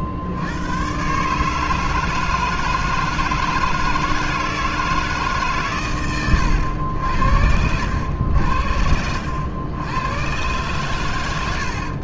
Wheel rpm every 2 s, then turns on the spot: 90, 160, 160, 90, 80, 100.
none